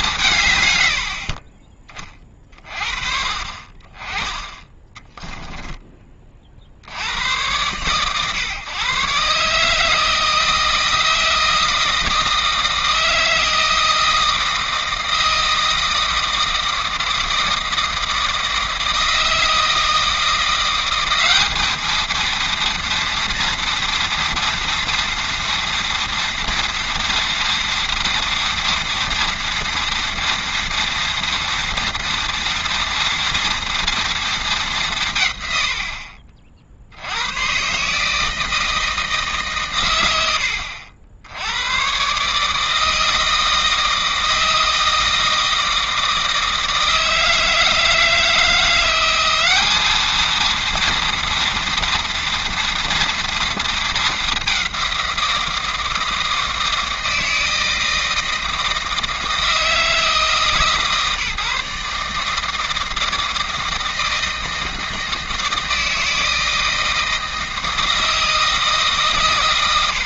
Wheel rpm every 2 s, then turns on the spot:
160, 30, 20, 30, 120, 160, 160, 160, 160, 160, 170, 230, 230, 230, 230, 230, 230, 230, 50, 160, 90, 140, 160, 160, 170, 220, 230, 200, 160, 160, 160, 160, 160, 160, 160.
none